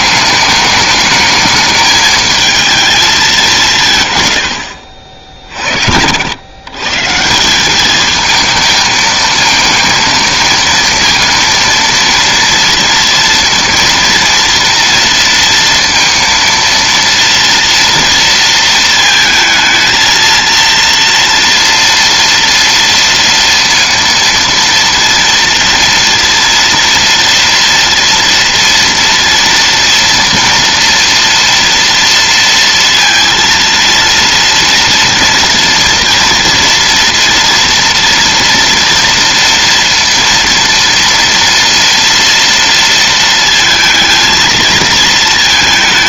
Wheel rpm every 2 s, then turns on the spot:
210, 210, 60, 160, 220, 230, 230, 230, 230, 220, 230, 230, 230, 230, 230, 230, 230, 230, 230, 230, 230, 230, 220.
none